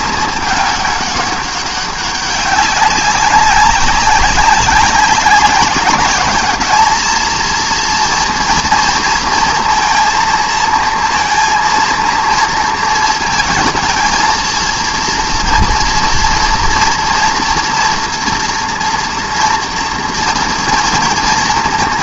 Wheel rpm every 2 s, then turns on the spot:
210, 190, 190, 220, 230, 230, 230, 230, 230, 230, 230.
none